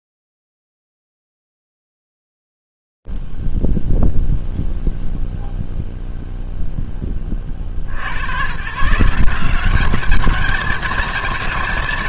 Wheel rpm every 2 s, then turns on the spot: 0, 0, 0, 0, 70, 200.
none